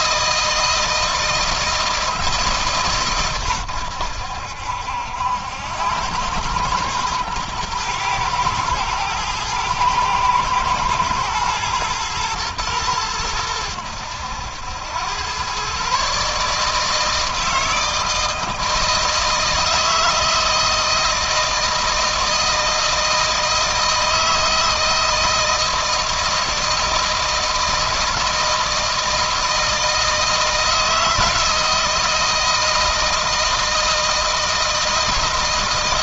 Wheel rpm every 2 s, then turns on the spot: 160, 130, 80, 110, 110, 110, 110, 100, 160, 160, 160, 160, 160, 160, 170, 160, 160, 160.
none